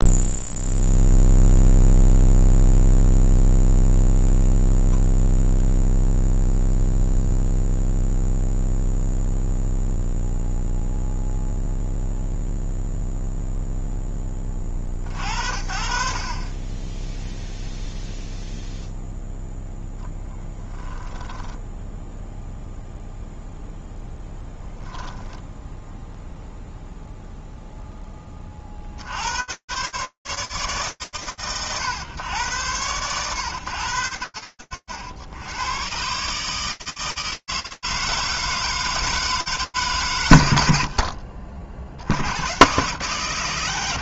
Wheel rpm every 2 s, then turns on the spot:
0, 0, 0, 0, 0, 0, 0, 40, 10, 0, 10, 0, 0, 0, 60, 110, 70, 140, 160, 70, 130, 20.
20-22 38-40